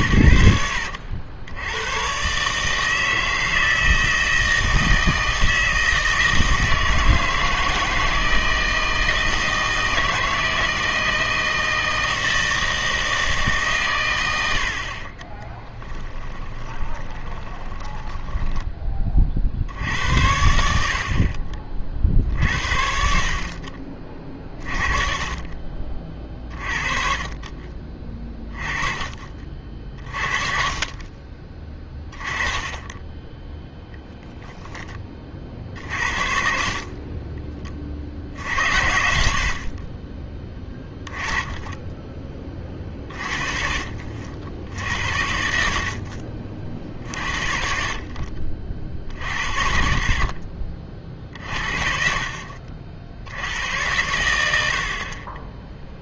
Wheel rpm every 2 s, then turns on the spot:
90, 150, 160, 160, 160, 160, 160, 80, 20, 20, 70, 70, 30, 40, 20, 40, 20, 10, 40, 70, 20, 30, 70, 50, 50, 40, 60, 60.
16-18